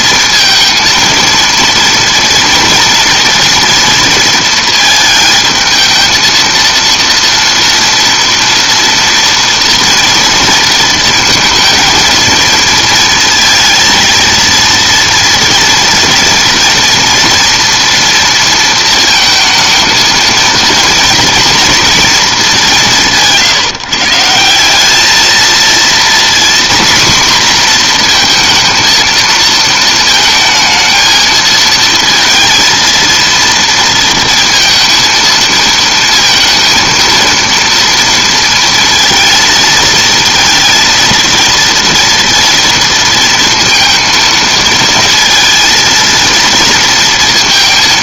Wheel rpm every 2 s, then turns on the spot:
230, 240, 220, 230, 230, 230, 230, 230, 230, 230, 230, 200, 190, 250, 230, 220, 230, 230, 230, 230, 230, 230, 230, 230.
none